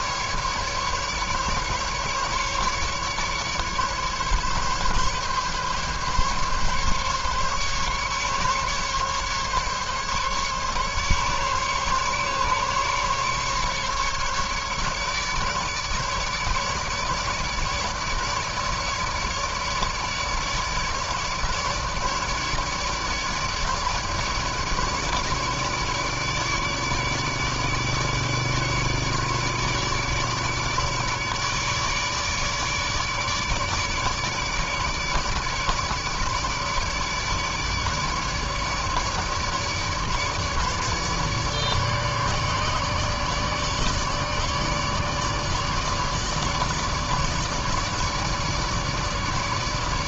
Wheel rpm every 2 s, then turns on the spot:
150, 150, 140, 140, 140, 140, 140, 150, 150, 150, 150, 150, 150, 150, 150, 150, 150, 150, 150, 150, 150, 150, 150, 150, 150.
none